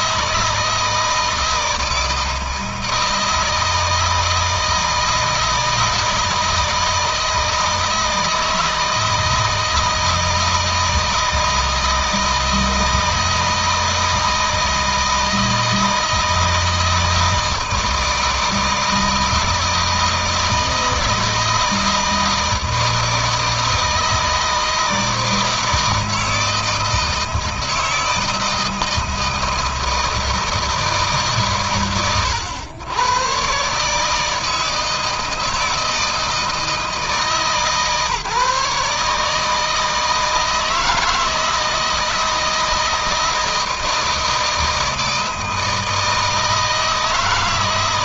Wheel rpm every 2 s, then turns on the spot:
160, 160, 160, 160, 160, 160, 160, 160, 160, 160, 160, 160, 160, 160, 160, 160, 110, 160, 160, 150, 160, 160, 160, 160.
none